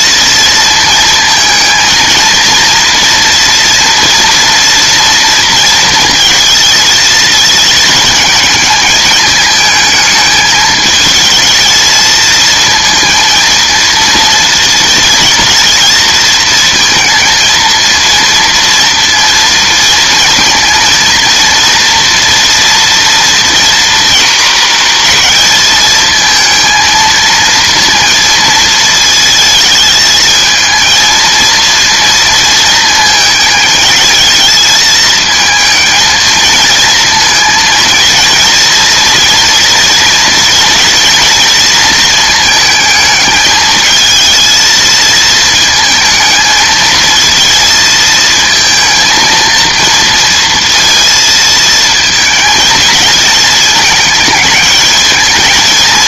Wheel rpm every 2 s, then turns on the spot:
230, 230, 230, 220, 220, 220, 230, 230, 220, 230, 230, 240, 230, 220, 220, 220, 230, 220, 230, 230, 230, 220, 230, 220, 230, 230, 220, 220.
none